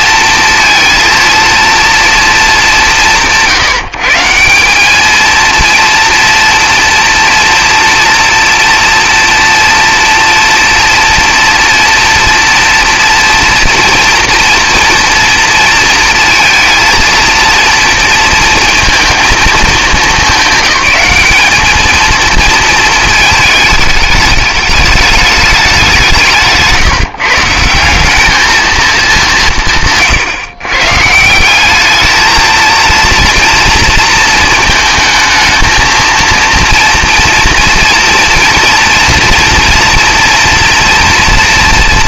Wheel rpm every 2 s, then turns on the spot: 230, 220, 180, 230, 240, 230, 230, 230, 230, 230, 200, 220, 210, 160, 220, 130, 230, 230, 230, 240, 240.
26-28